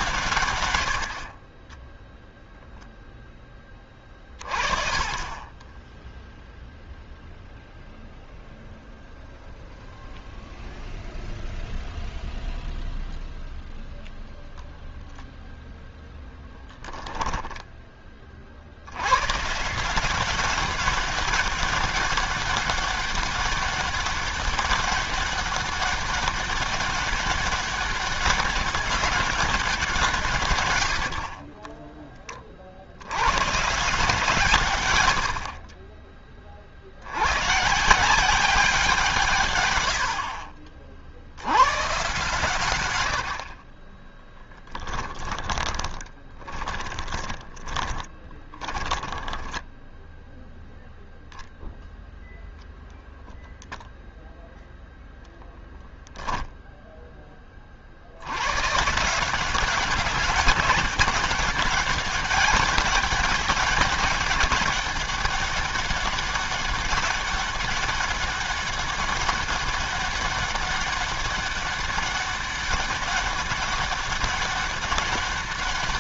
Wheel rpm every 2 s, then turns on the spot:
130, 0, 30, 0, 0, 0, 0, 0, 0, 80, 190, 200, 200, 200, 200, 130, 60, 130, 40, 190, 50, 120, 10, 20, 20, 0, 0, 0, 0, 110, 190, 200, 200, 200, 200, 200, 200, 200.
44-50